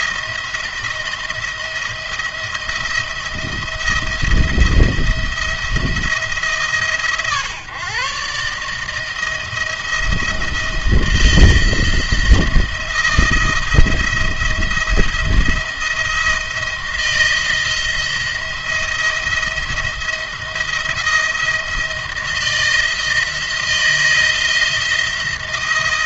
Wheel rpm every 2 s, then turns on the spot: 170, 170, 170, 150, 140, 170, 170, 170, 170, 170, 170, 170, 170.
none